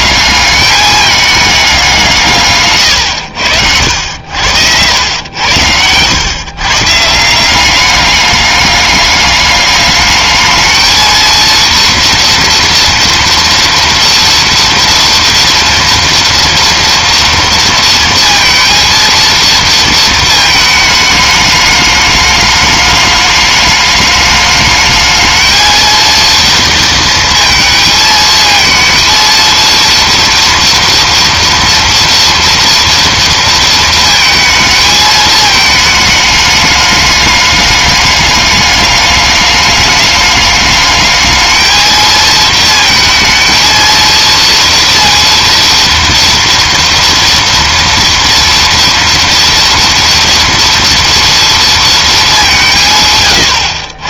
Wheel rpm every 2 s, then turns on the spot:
210, 120, 90, 130, 210, 220, 230, 230, 230, 230, 220, 210, 210, 230, 230, 230, 230, 220, 210, 210, 210, 230, 230, 230, 230, 230, 180.
none